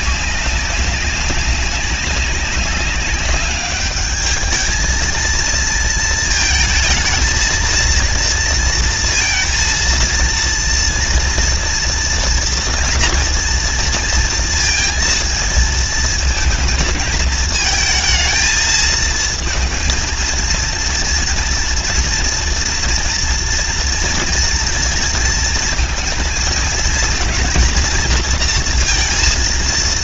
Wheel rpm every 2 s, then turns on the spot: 190, 200, 210, 220, 230, 230, 230, 230, 220, 220, 220, 230, 230, 220, 230.
none